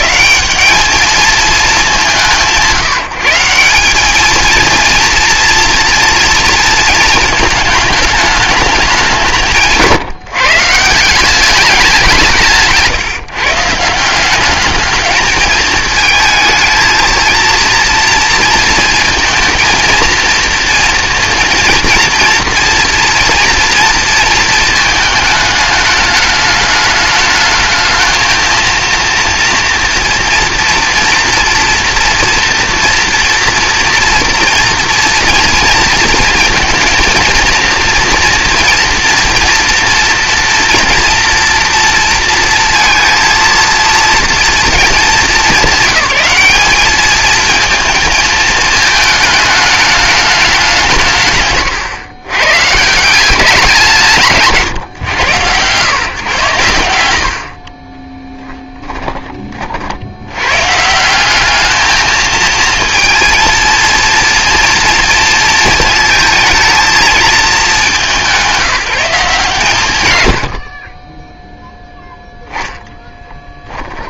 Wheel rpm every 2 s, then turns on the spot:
210, 170, 230, 230, 210, 160, 160, 210, 220, 230, 230, 230, 220, 210, 230, 240, 230, 230, 230, 230, 230, 230, 220, 210, 220, 180, 130, 150, 120, 10, 140, 230, 230, 220, 180, 70, 0.
58-60